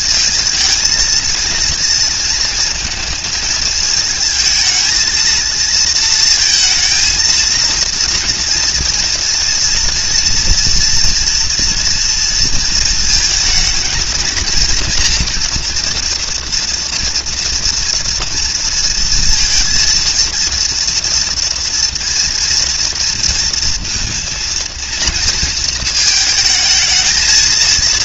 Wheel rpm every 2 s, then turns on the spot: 230, 230, 220, 230, 230, 230, 230, 230, 230, 230, 230, 230, 230, 220.
none